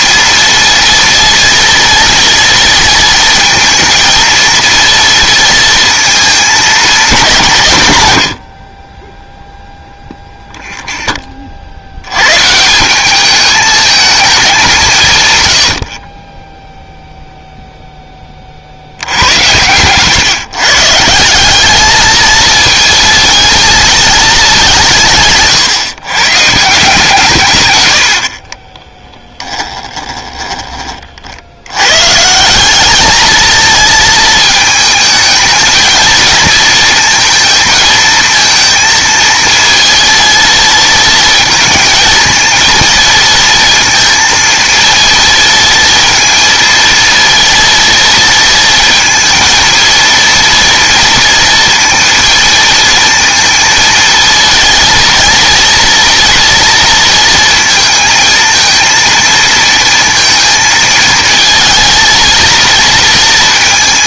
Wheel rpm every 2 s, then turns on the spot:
230, 230, 230, 210, 50, 0, 170, 180, 0, 70, 150, 220, 180, 160, 30, 20, 190, 220, 230, 230, 230, 230, 230, 230, 230, 230, 230, 230, 230, 230, 230, 230.
28-30